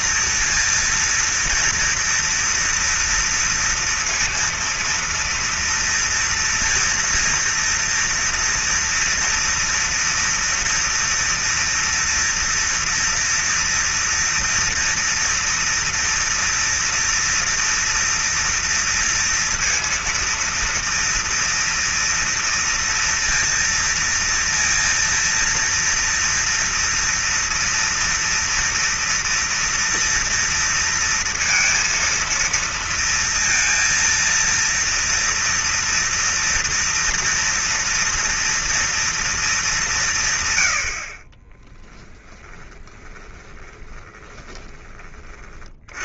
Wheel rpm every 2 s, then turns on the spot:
230, 230, 230, 230, 230, 230, 230, 230, 230, 230, 230, 230, 230, 230, 230, 230, 230, 230, 230, 230, 80, 20, 20.
42-44